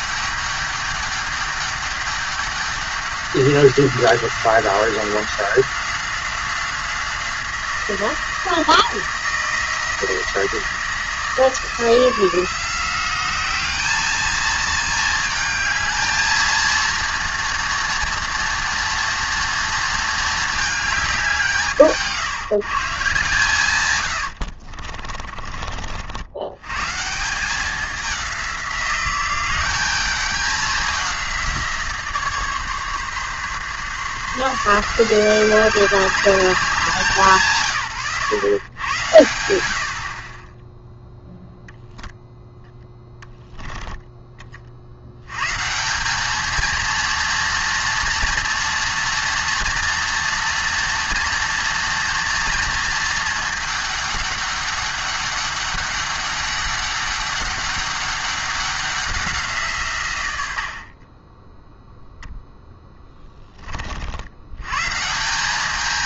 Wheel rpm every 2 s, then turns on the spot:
200, 200, 180, 180, 170, 170, 170, 220, 230, 230, 220, 150, 60, 120, 180, 200, 140, 170, 190, 110, 10, 0, 40, 220, 230, 230, 230, 200, 200, 200, 60, 10, 110.
24-26 60-62